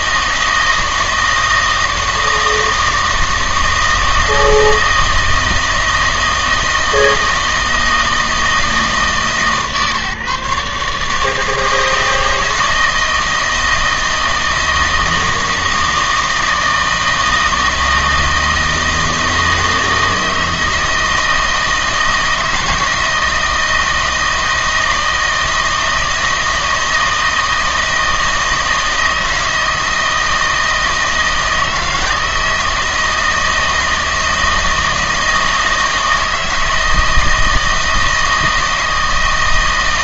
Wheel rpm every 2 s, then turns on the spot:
160, 160, 160, 160, 160, 150, 160, 160, 160, 160, 160, 170, 160, 160, 160, 160, 160, 160, 160, 160.
none